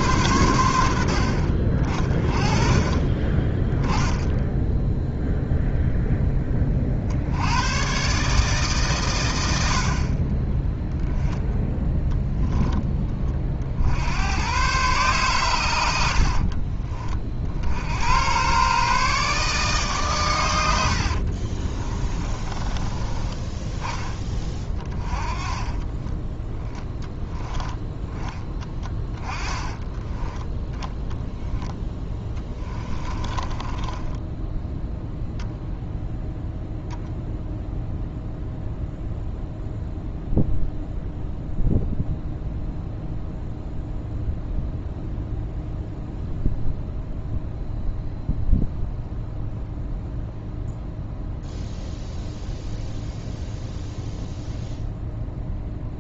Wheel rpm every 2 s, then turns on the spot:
80, 30, 0, 40, 130, 0, 10, 120, 30, 140, 80, 20, 30, 10, 20, 10, 20, 0, 0, 0, 0, 0, 0, 0, 0, 0, 0, 0.
20-22 28-30 32-34